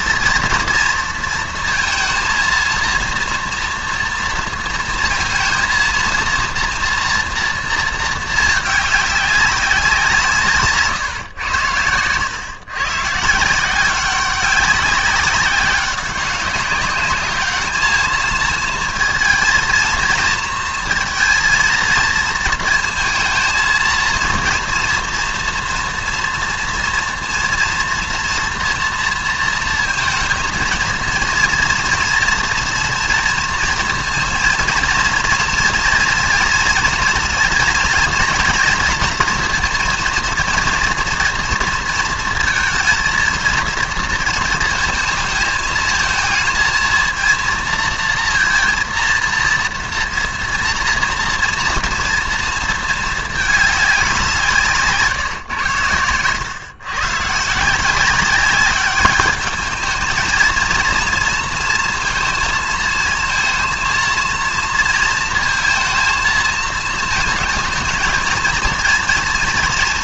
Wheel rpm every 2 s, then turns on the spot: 230, 230, 230, 230, 210, 150, 120, 190, 200, 230, 230, 230, 230, 230, 230, 220, 230, 220, 230, 230, 230, 220, 230, 220, 230, 230, 230, 170, 110, 200, 220, 230, 230, 230, 230.
none